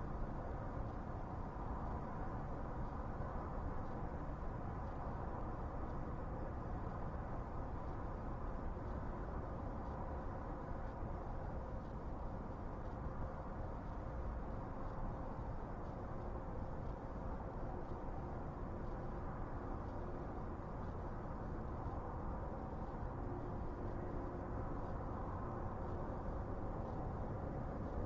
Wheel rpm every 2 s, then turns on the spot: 0, 0, 0, 0, 0, 0, 0, 0, 0, 0, 0, 0, 0, 0.
none